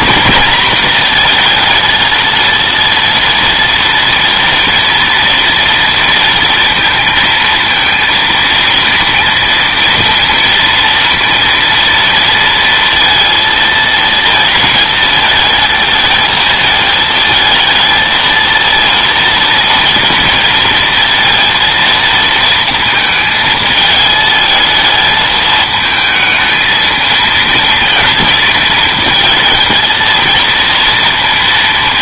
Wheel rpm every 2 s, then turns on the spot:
220, 230, 230, 230, 230, 230, 230, 220, 230, 230, 230, 230, 220, 220, 230, 230.
none